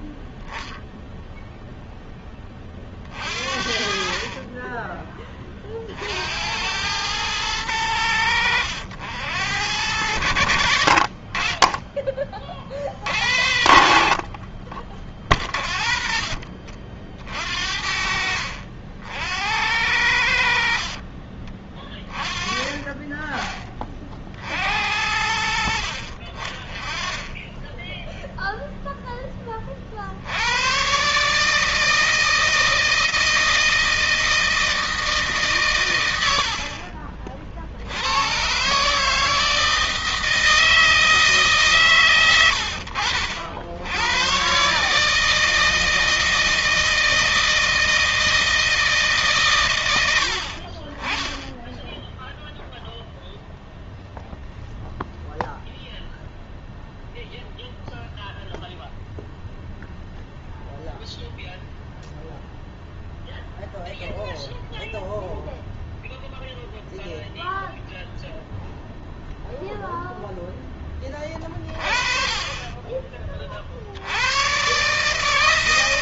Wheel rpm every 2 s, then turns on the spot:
0, 40, 30, 110, 80, 40, 70, 30, 50, 70, 60, 20, 50, 30, 0, 90, 160, 160, 70, 130, 160, 100, 120, 160, 160, 50, 0, 0, 0, 0, 0, 0, 0, 0, 0, 10, 20, 110.
none